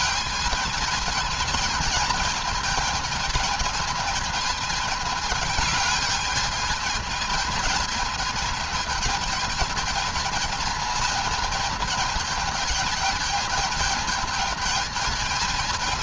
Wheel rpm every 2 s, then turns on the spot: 220, 220, 220, 220, 220, 220, 210, 220.
none